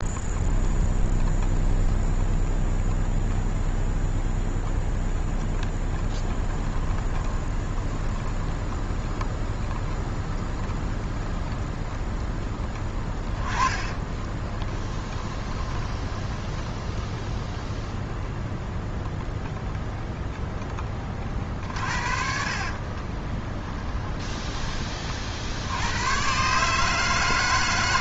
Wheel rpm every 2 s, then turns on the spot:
0, 0, 0, 20, 10, 0, 10, 20, 0, 0, 10, 40, 30, 150.
6-8 12-16 22-24